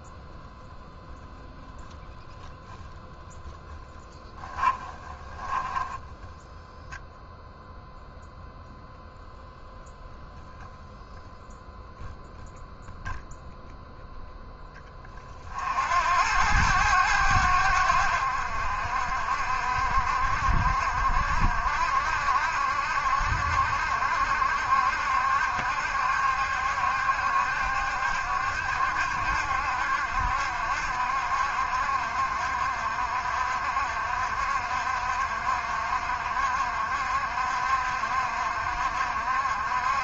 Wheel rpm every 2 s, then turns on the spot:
10, 10, 10, 0, 0, 0, 0, 30, 90, 60, 60, 70, 70, 70, 70, 60, 60, 60, 60, 60.
4-6